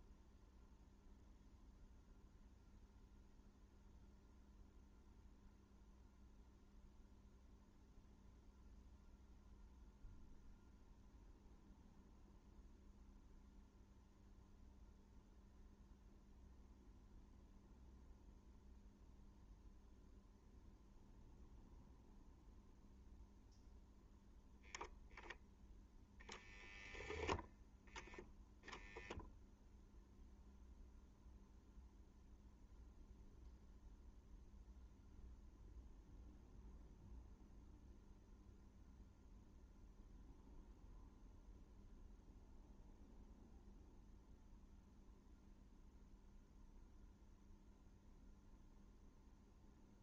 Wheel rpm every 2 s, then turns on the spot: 0, 0, 0, 0, 0, 0, 0, 0, 0, 0, 0, 0, 0, 0, 0, 0, 0, 0, 0, 0, 0, 0, 0, 0, 0.
none